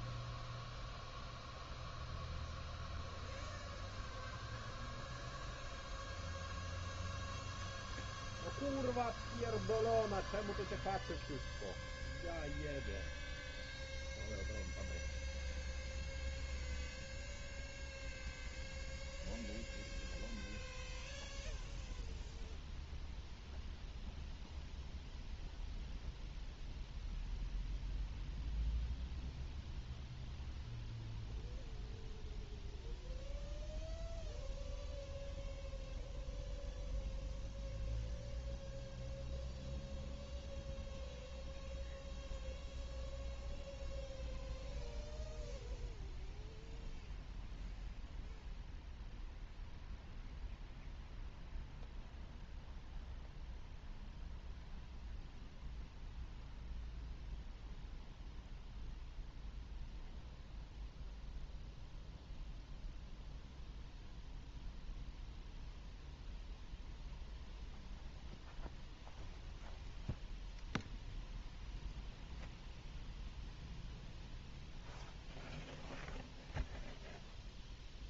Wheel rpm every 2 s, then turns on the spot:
0, 0, 0, 0, 0, 0, 0, 0, 0, 0, 0, 0, 0, 0, 0, 0, 0, 0, 0, 0, 0, 0, 0, 0, 0, 0, 0, 0, 0, 0, 0, 0, 0, 0, 0, 0, 0, 0, 0.
none